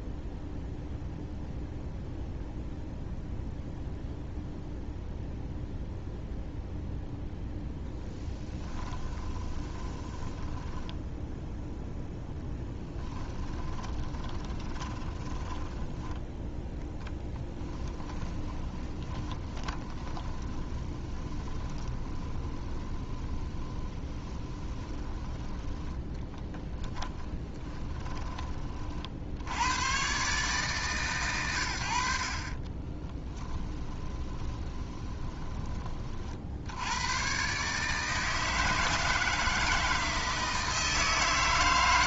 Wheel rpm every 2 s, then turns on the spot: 0, 0, 0, 0, 20, 10, 10, 20, 10, 20, 20, 20, 20, 10, 40, 140, 30, 20, 80, 160, 160.
8-16 18-28 32-36